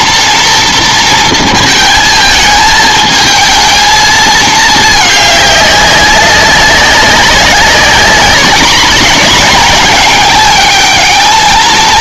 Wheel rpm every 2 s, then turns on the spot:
230, 220, 220, 200, 200, 210.
none